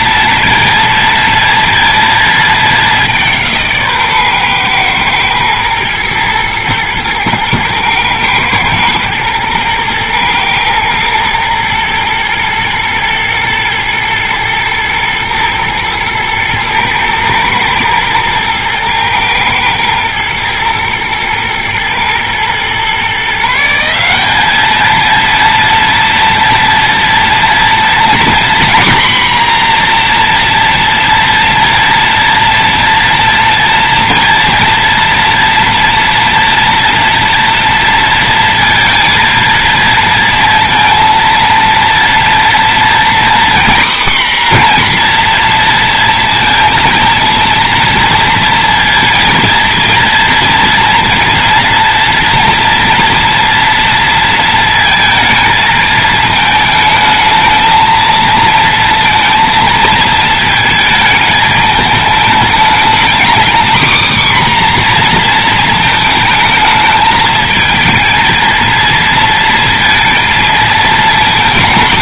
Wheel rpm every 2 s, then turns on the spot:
230, 190, 120, 110, 110, 110, 120, 110, 120, 110, 110, 130, 220, 230, 250, 240, 230, 230, 230, 230, 230, 240, 240, 230, 230, 230, 230, 230, 220, 230, 220, 230, 250, 220, 230, 220.
none